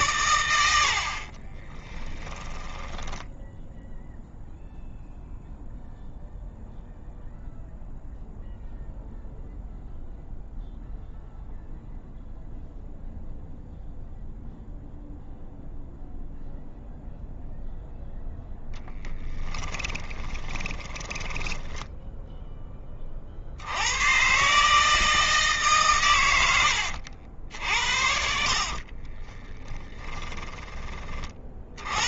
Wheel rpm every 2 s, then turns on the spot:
50, 10, 0, 0, 0, 0, 0, 0, 0, 10, 20, 30, 150, 70, 30, 30.
0-4 18-22 28-30